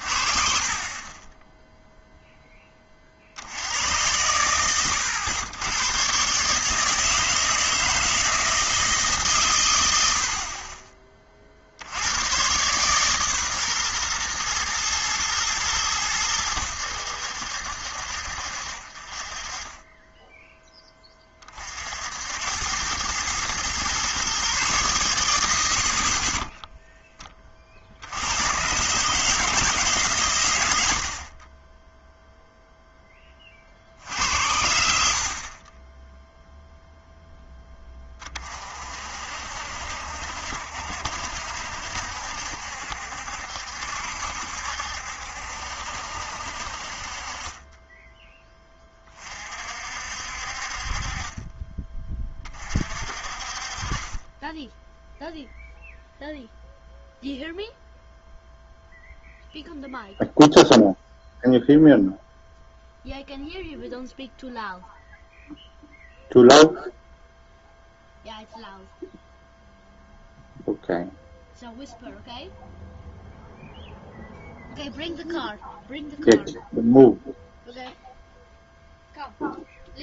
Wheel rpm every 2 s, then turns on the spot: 40, 20, 110, 150, 160, 40, 120, 110, 90, 50, 10, 90, 130, 10, 120, 100, 0, 70, 0, 40, 70, 70, 70, 60, 20, 50, 40, 10, 0, 0, 0, 0, 0, 0, 0, 0, 0, 0, 0, 0.
26-28